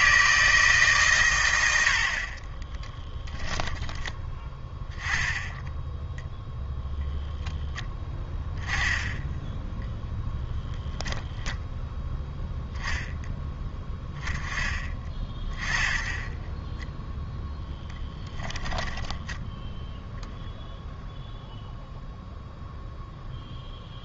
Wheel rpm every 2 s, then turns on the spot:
160, 20, 10, 0, 0, 0, 0, 20, 10, 10, 0, 0.
2-4 18-20